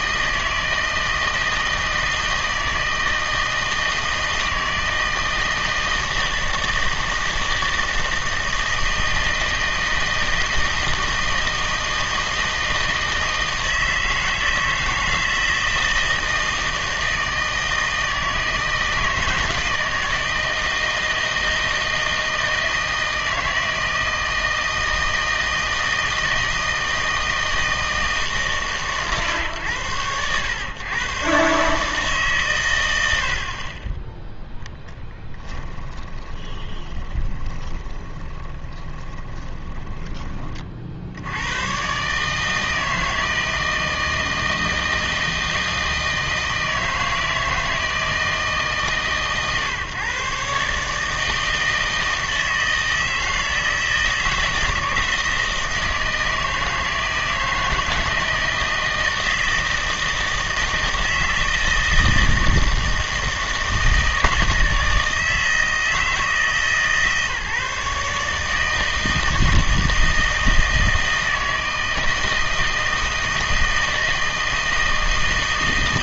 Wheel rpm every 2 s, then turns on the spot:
160, 160, 160, 160, 160, 160, 160, 160, 160, 160, 160, 160, 160, 160, 130, 120, 100, 0, 20, 20, 50, 160, 160, 160, 140, 150, 160, 160, 160, 160, 160, 160, 160, 160, 160, 160, 160, 160.
36-40